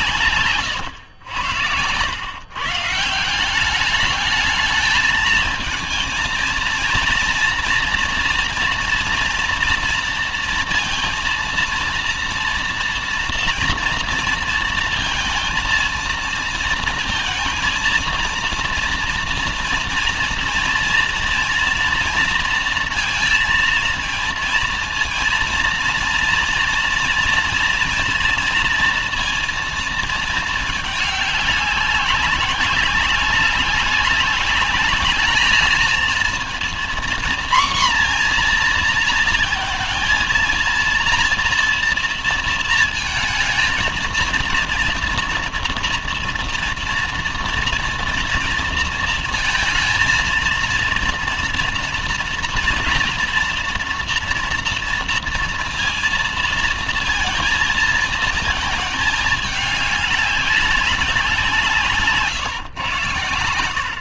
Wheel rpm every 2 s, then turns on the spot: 120, 140, 220, 230, 230, 230, 230, 230, 230, 230, 230, 230, 230, 230, 230, 220, 200, 200, 230, 240, 230, 230, 230, 230, 230, 230, 230, 230, 230, 220, 200, 130.
none